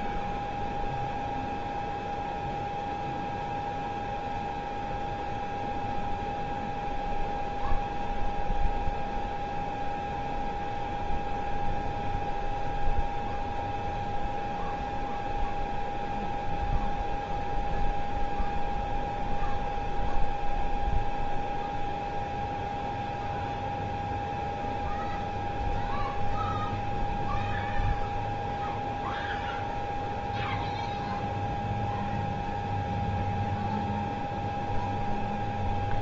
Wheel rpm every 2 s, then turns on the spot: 0, 0, 0, 0, 0, 0, 0, 0, 0, 0, 0, 0, 0, 0, 0, 0, 0, 0.
none